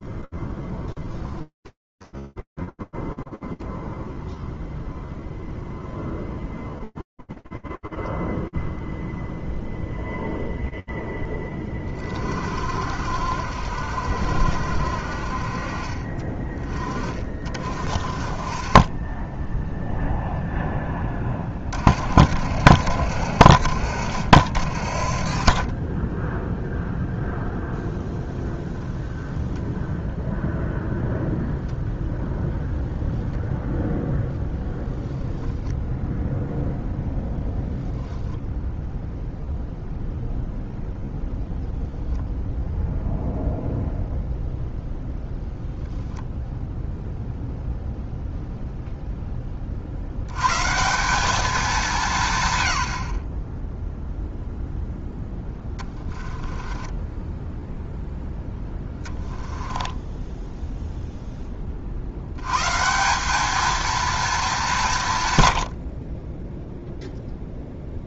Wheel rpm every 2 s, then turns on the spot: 10, 0, 0, 0, 20, 70, 40, 40, 0, 20, 70, 40, 0, 0, 0, 0, 0, 0, 10, 0, 0, 0, 0, 0, 60, 190, 0, 10, 0, 10, 30, 220, 80, 0.
36-38 54-56